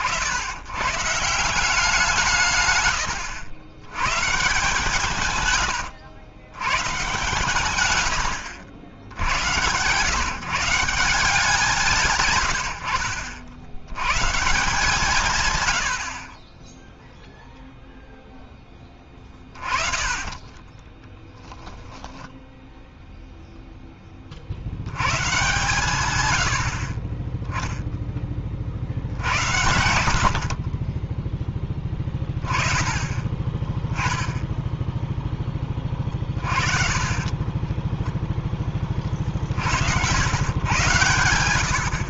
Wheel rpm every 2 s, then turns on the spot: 100, 130, 150, 110, 80, 150, 100, 160, 20, 10, 20, 0, 60, 80, 40, 40, 30, 10, 30, 20, 110.
20-22 36-38